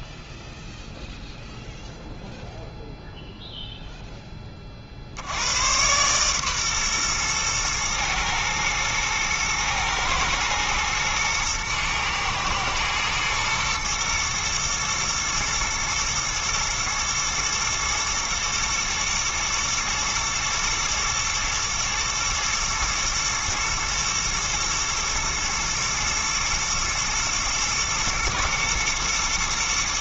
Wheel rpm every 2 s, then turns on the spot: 0, 0, 30, 130, 120, 120, 110, 120, 110, 120, 110, 110, 110, 110, 120.
none